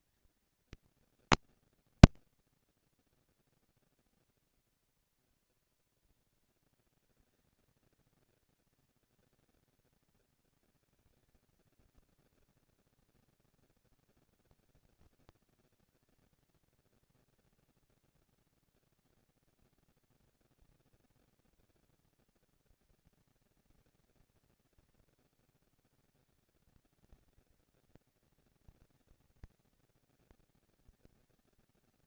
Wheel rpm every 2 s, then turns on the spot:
230, 230, 230, 230, 230, 230, 230, 230, 230, 230, 230, 230, 220, 200, 190, 200.
none